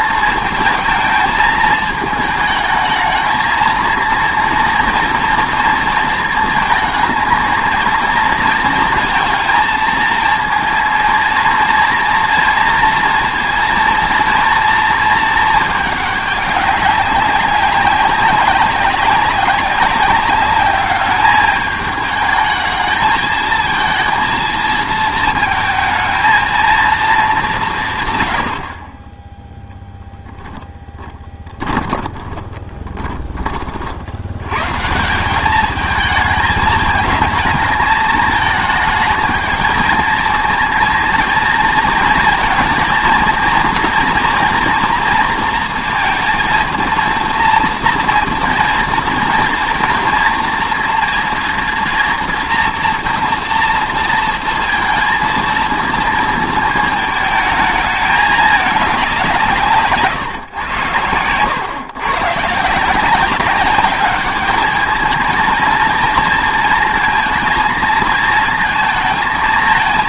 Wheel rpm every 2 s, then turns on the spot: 220, 220, 230, 220, 230, 230, 230, 230, 200, 190, 210, 220, 220, 230, 50, 10, 20, 140, 220, 220, 230, 230, 240, 230, 230, 240, 240, 230, 220, 210, 110, 150, 220, 230, 220.
32-34